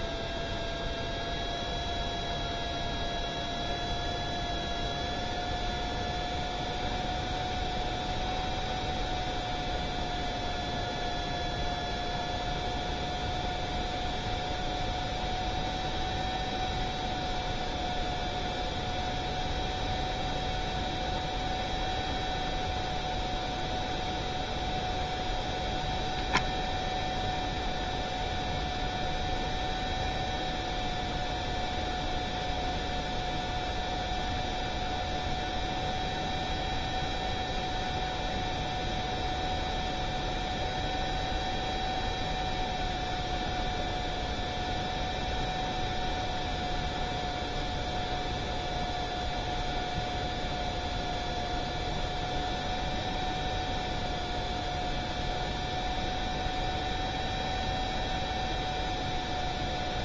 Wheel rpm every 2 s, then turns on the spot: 0, 0, 0, 0, 0, 0, 0, 0, 0, 0, 0, 0, 0, 0, 0, 0, 0, 0, 0, 0, 0, 0, 0, 0, 0, 0, 0, 0, 0, 0.
none